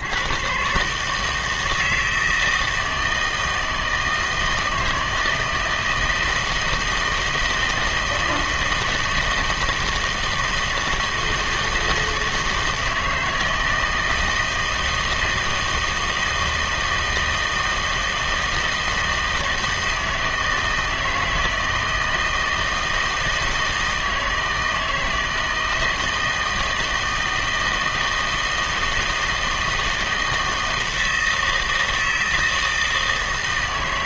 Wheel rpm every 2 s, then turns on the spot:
130, 160, 160, 160, 160, 160, 160, 160, 160, 160, 160, 160, 160, 160, 160, 160, 160.
none